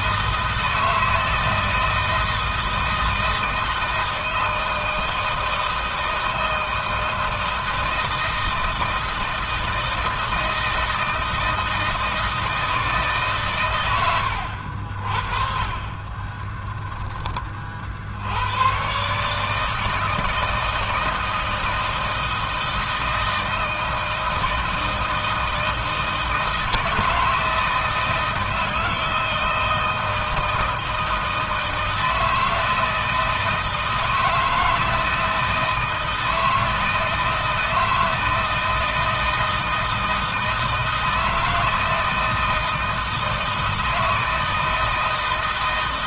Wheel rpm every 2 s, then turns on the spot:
160, 160, 160, 160, 160, 160, 160, 60, 10, 130, 160, 160, 160, 160, 160, 160, 160, 160, 160, 160, 160, 160, 160.
none